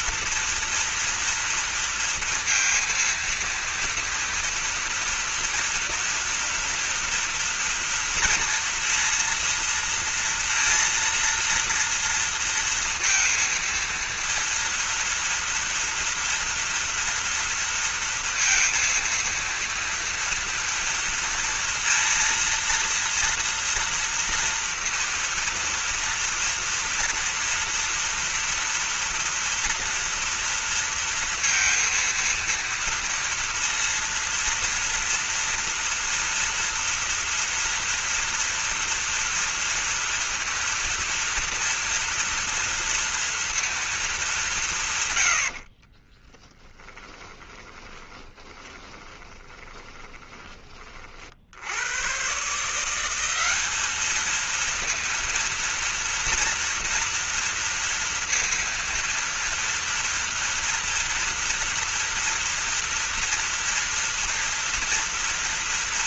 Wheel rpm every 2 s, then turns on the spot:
230, 230, 240, 240, 230, 230, 230, 230, 230, 230, 230, 230, 230, 230, 240, 230, 230, 230, 230, 230, 230, 230, 130, 30, 20, 40, 180, 230, 240, 230, 230, 230, 230.
46-50